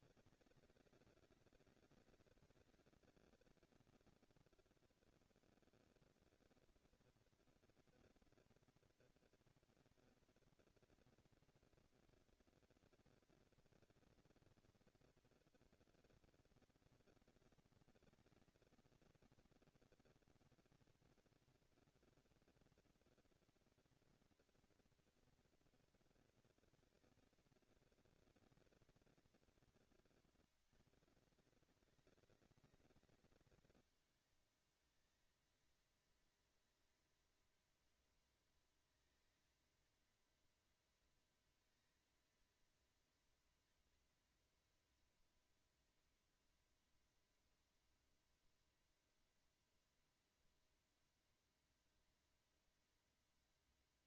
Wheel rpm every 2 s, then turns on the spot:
200, 210, 230, 230, 230, 230, 230, 230, 240, 230, 230, 240, 230, 230, 220, 190, 190, 210, 230, 230, 230, 230, 230, 230, 230, 230, 230.
none